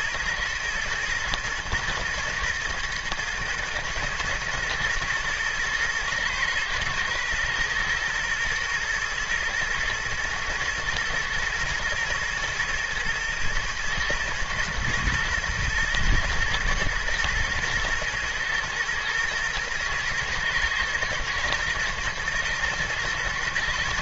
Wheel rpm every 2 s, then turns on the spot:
120, 120, 120, 120, 120, 110, 110, 120, 110, 110, 120, 120.
none